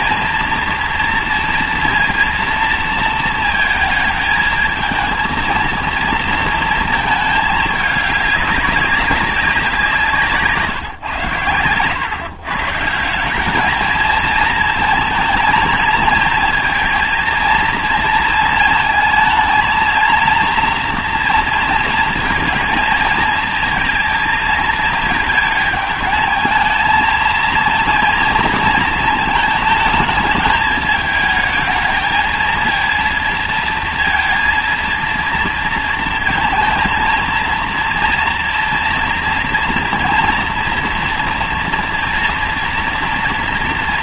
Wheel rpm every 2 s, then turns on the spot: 230, 230, 220, 230, 200, 140, 150, 220, 230, 220, 230, 230, 230, 220, 230, 210, 230, 230, 230, 240, 230, 230.
none